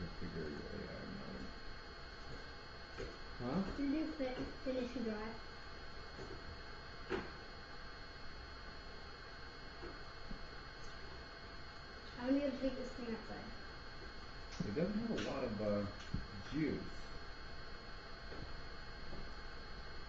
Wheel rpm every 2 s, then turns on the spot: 0, 0, 0, 0, 0, 0, 0, 0, 0, 0.
none